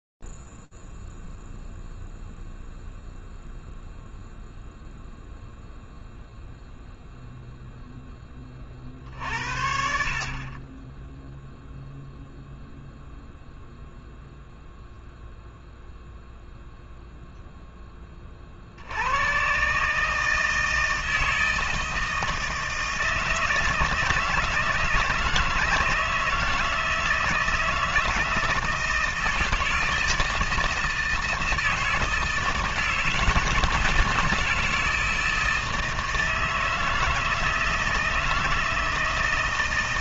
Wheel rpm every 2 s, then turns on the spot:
0, 0, 0, 0, 30, 30, 0, 0, 0, 60, 160, 160, 160, 160, 160, 160, 160, 160, 160, 160.
none